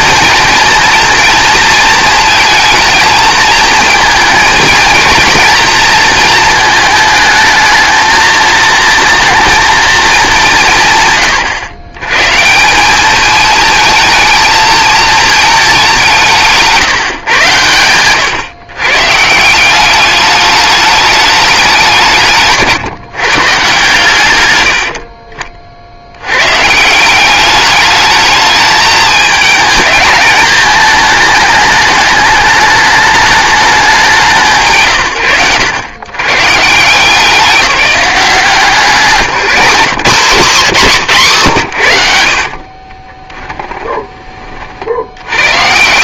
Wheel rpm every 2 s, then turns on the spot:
230, 220, 230, 220, 230, 150, 190, 220, 150, 130, 210, 150, 70, 180, 220, 220, 210, 80, 160, 180, 190, 30, 70.
42-44